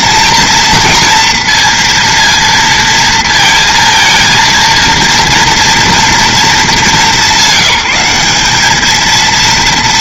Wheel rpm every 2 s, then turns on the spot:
230, 230, 230, 220, 210.
none